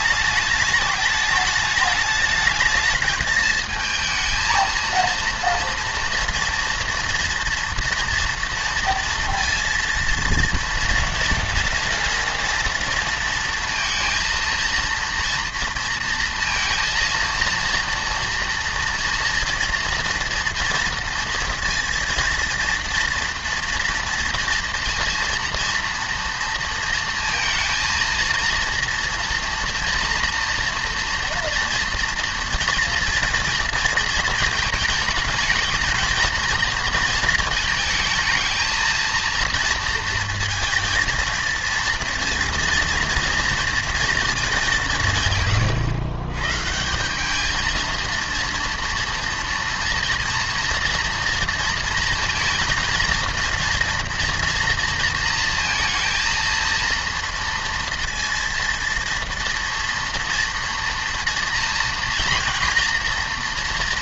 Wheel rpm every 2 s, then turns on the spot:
210, 220, 230, 230, 230, 230, 230, 230, 230, 230, 230, 230, 230, 230, 230, 230, 240, 220, 230, 220, 230, 230, 180, 150, 240, 240, 230, 230, 230, 230, 230, 230.
none